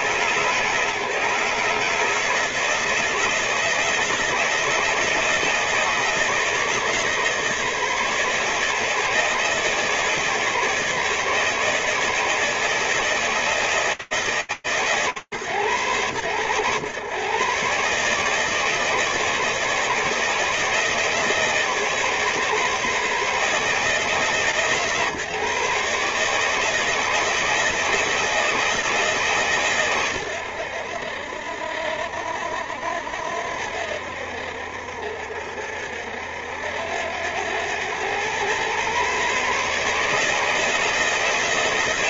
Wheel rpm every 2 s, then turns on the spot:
160, 160, 160, 150, 160, 150, 160, 120, 140, 150, 150, 150, 140, 160, 130, 60, 70, 70, 100, 150, 160.
none